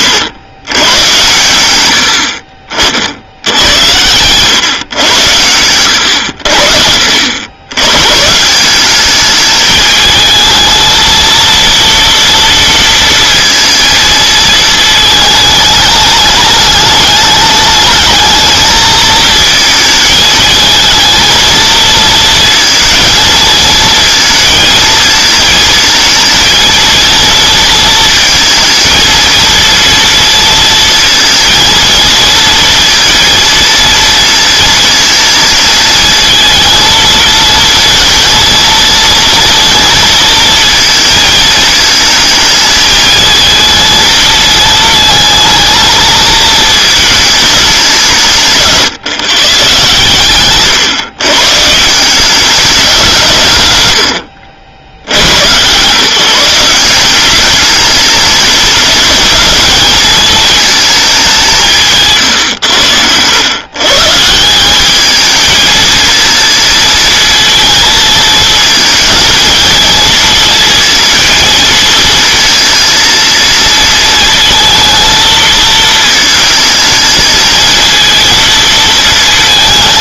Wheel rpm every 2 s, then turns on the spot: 110, 60, 110, 60, 190, 230, 230, 220, 210, 220, 220, 230, 230, 230, 220, 230, 230, 220, 220, 230, 230, 220, 220, 220, 150, 130, 190, 80, 170, 210, 220, 100, 200, 230, 230, 230, 230, 220, 220, 220.
none